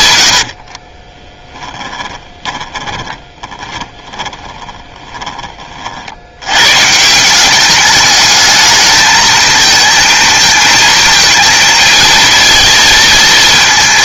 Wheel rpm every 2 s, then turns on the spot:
60, 10, 20, 100, 220, 220, 230.
0-6